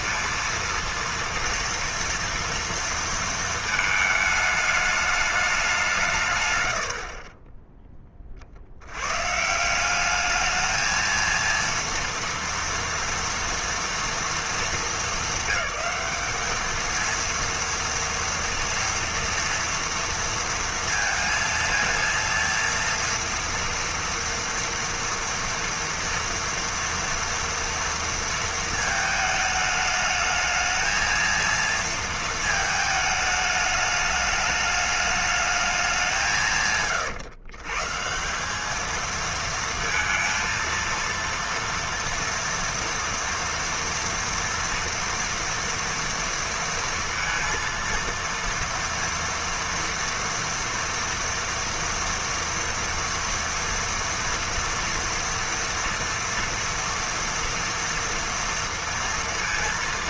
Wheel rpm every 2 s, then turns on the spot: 230, 230, 210, 110, 80, 220, 230, 220, 220, 230, 230, 230, 230, 230, 230, 220, 220, 210, 140, 210, 230, 230, 230, 230, 230, 230, 230, 230, 230, 230.
none